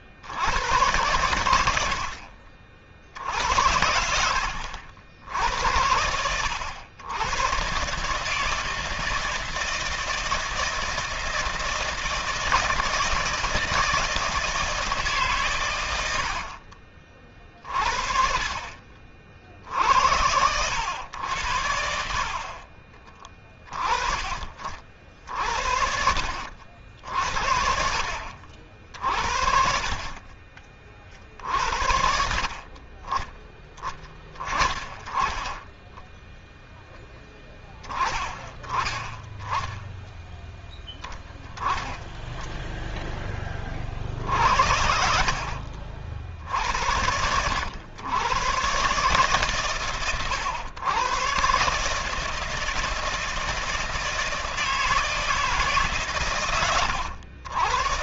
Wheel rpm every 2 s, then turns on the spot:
110, 60, 70, 90, 160, 160, 160, 150, 50, 50, 100, 30, 50, 60, 50, 40, 30, 30, 0, 20, 0, 10, 70, 70, 130, 120, 160, 160, 100.
none